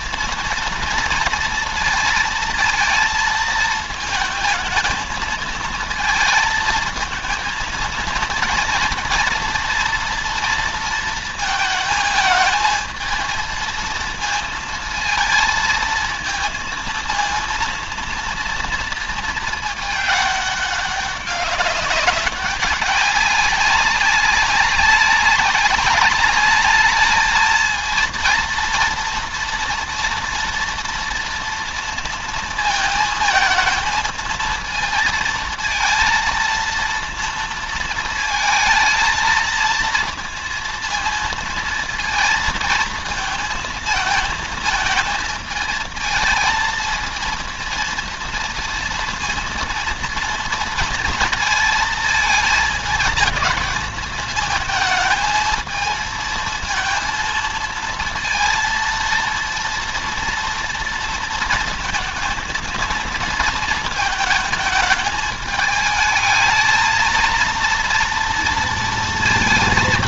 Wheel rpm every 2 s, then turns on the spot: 230, 230, 220, 220, 230, 230, 220, 230, 230, 230, 200, 200, 190, 210, 230, 230, 230, 220, 230, 220, 230, 230, 220, 230, 230, 230, 220, 220, 220, 230, 230, 230, 220, 220, 230.
none